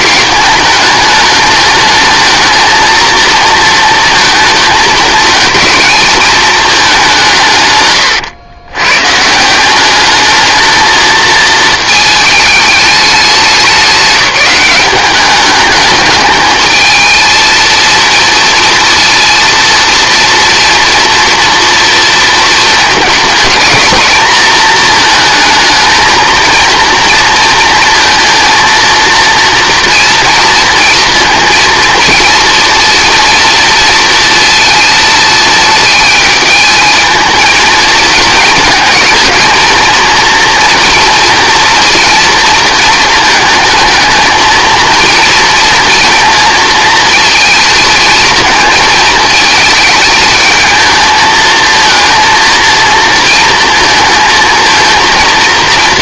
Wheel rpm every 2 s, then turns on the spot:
220, 220, 220, 210, 110, 220, 210, 190, 220, 230, 240, 220, 220, 230, 230, 230, 230, 230, 220, 220, 230, 220, 220, 230, 220, 220, 230, 230.
none